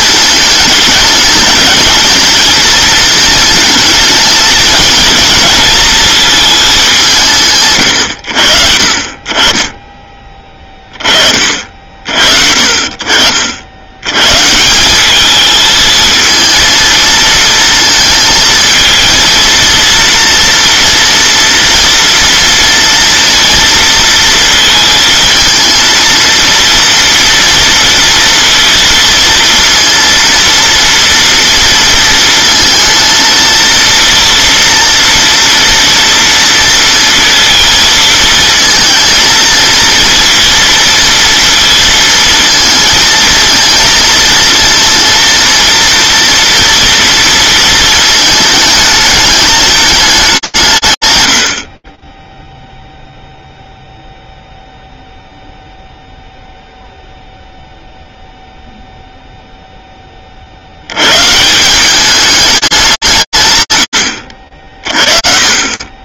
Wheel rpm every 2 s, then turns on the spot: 210, 220, 220, 210, 60, 20, 60, 160, 230, 220, 230, 230, 220, 230, 230, 230, 230, 230, 230, 220, 230, 230, 230, 230, 220, 170, 0, 0, 0, 0, 120, 160, 40.
none